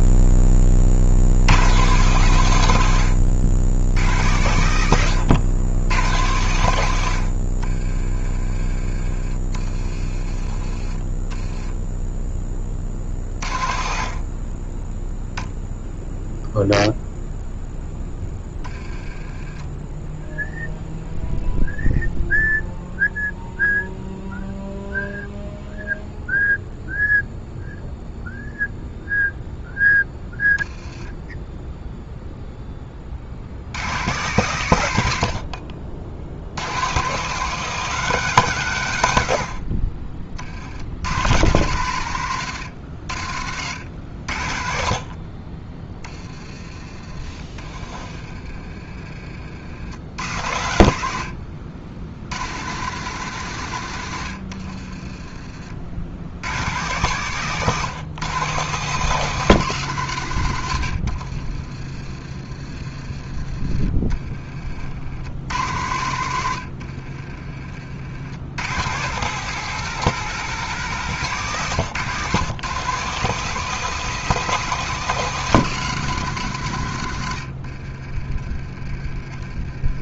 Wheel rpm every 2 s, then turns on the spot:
40, 100, 100, 100, 30, 20, 30, 10, 0, 10, 0, 0, 0, 0, 0, 10, 20, 120, 120, 110, 80, 90, 50, 30, 30, 70, 130, 40, 120, 150, 80, 30, 50, 70, 120, 170, 140, 170, 100, 30.
10-12 30-32 48-50 54-56 60-62 66-68